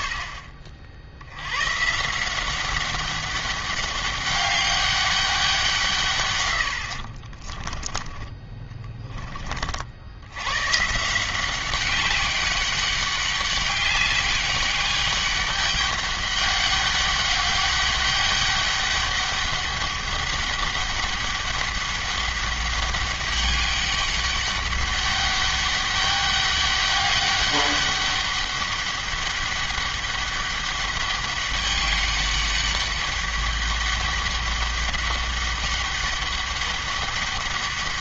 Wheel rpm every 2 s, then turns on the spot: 50, 190, 200, 90, 20, 140, 200, 200, 200, 200, 200, 200, 200, 200, 200, 200, 200, 200, 200.
8-10